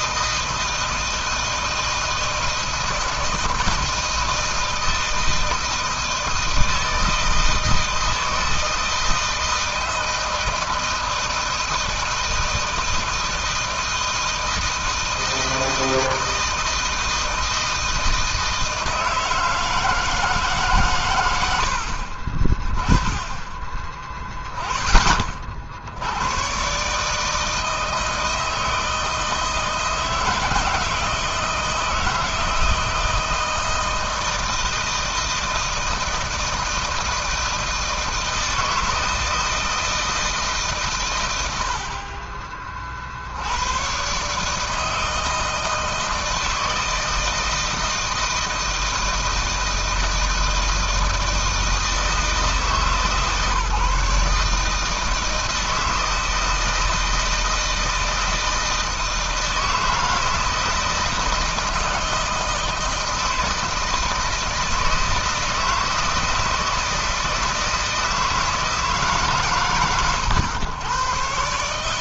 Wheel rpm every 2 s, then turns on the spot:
160, 160, 160, 160, 160, 160, 160, 160, 160, 160, 150, 30, 10, 110, 160, 160, 160, 160, 160, 160, 150, 40, 150, 160, 160, 160, 150, 150, 160, 160, 160, 160, 160, 160, 160, 100.
none